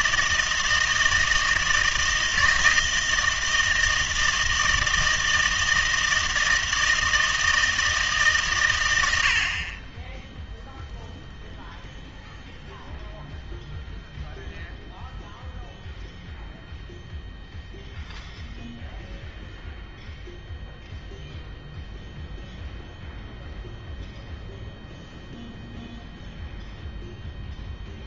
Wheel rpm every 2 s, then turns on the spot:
160, 160, 160, 160, 120, 0, 0, 0, 0, 0, 0, 0, 0, 0.
none